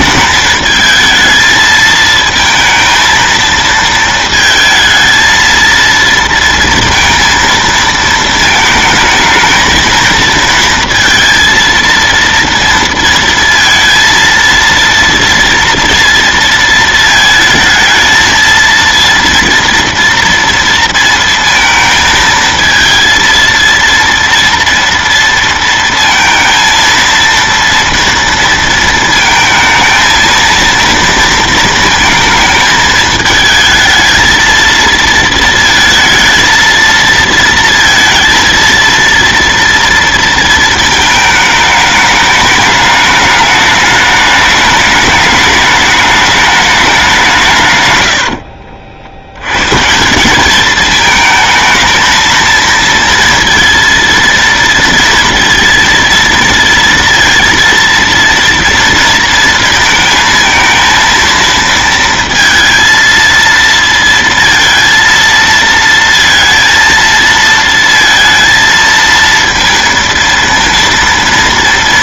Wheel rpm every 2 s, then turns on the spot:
220, 230, 220, 230, 220, 230, 230, 230, 230, 230, 230, 220, 230, 230, 230, 230, 220, 220, 230, 230, 220, 210, 210, 200, 60, 210, 230, 230, 230, 230, 230, 230, 230, 230, 230, 230.
48-50